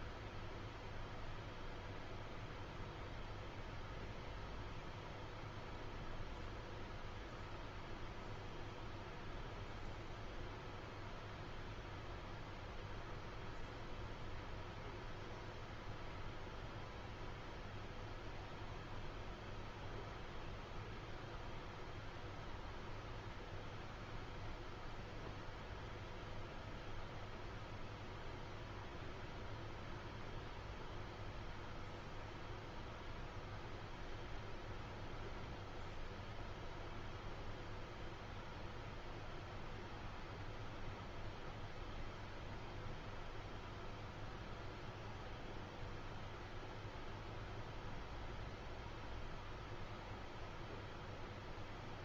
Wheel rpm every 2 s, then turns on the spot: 0, 0, 0, 0, 0, 0, 0, 0, 0, 0, 0, 0, 0, 0, 0, 0, 0, 0, 0, 0, 0, 0, 0, 0, 0, 0.
none